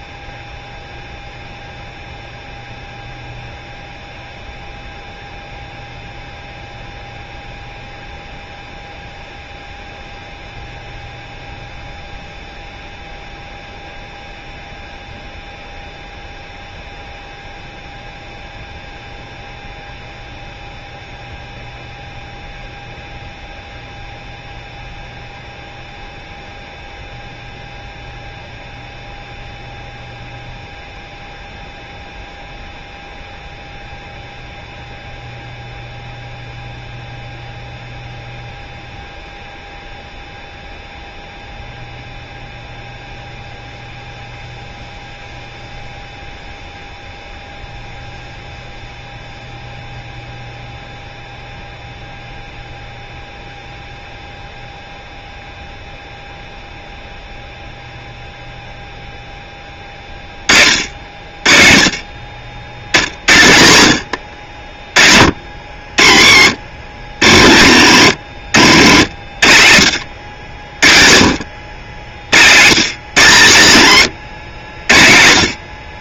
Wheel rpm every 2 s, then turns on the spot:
0, 0, 0, 0, 0, 0, 0, 0, 0, 0, 0, 0, 0, 0, 0, 0, 0, 0, 0, 0, 0, 0, 0, 0, 0, 0, 0, 0, 0, 0, 40, 60, 50, 70, 70, 60, 130, 70.
none